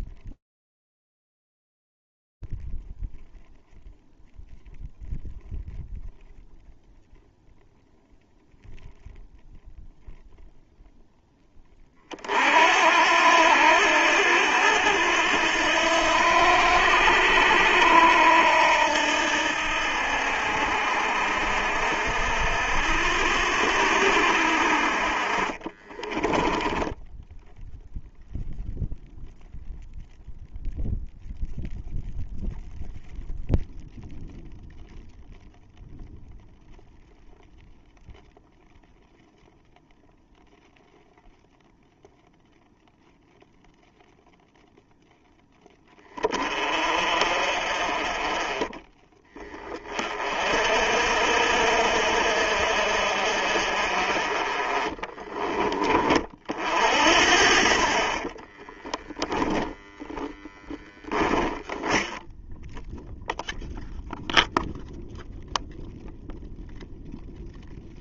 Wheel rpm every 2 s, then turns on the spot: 0, 0, 0, 0, 0, 0, 50, 90, 80, 80, 60, 70, 70, 10, 0, 0, 0, 0, 0, 0, 0, 0, 0, 40, 10, 50, 50, 20, 60, 10, 10, 0, 0, 0.
26-28 54-56 58-62